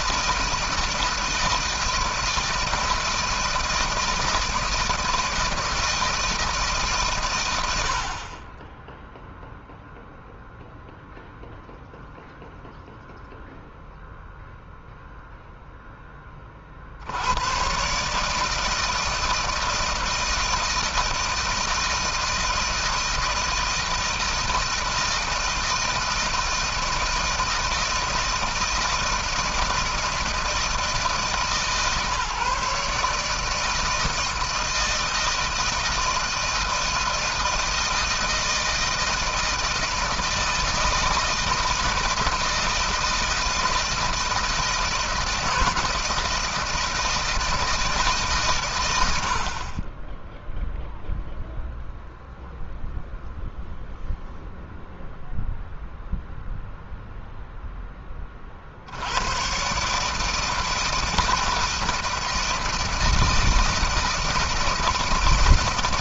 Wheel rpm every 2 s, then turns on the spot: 160, 160, 160, 140, 10, 0, 0, 0, 70, 160, 160, 160, 160, 160, 160, 160, 150, 160, 160, 160, 160, 160, 170, 160, 110, 0, 0, 0, 0, 80, 160, 160, 160.
none